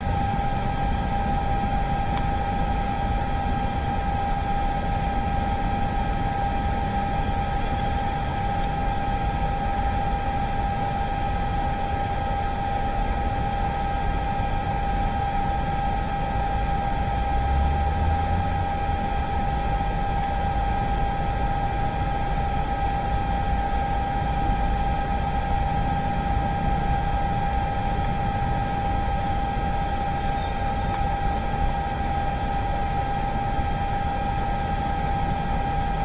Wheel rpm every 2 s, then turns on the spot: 0, 0, 0, 0, 0, 0, 0, 0, 0, 0, 0, 0, 0, 0, 0, 0, 0, 0.
none